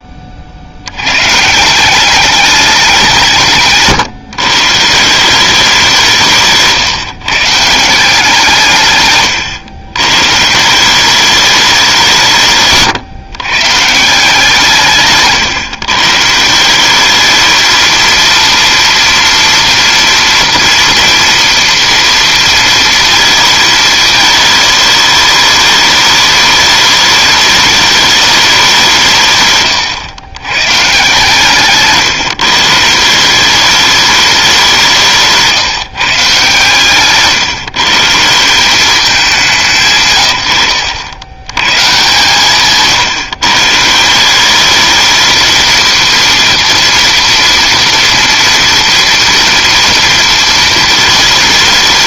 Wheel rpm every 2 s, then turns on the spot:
70, 200, 140, 160, 140, 170, 140, 160, 180, 230, 230, 230, 220, 210, 190, 130, 170, 180, 130, 190, 90, 160, 210, 230, 230, 220.
42-44